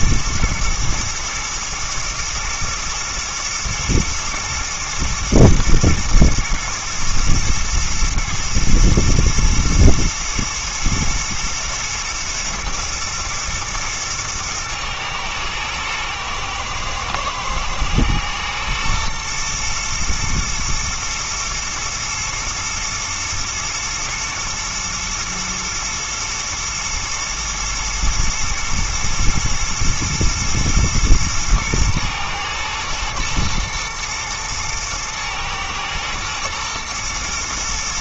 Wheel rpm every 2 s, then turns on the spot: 120, 110, 110, 120, 120, 110, 120, 120, 110, 120, 120, 120, 120, 120, 120, 110, 110, 110, 110.
none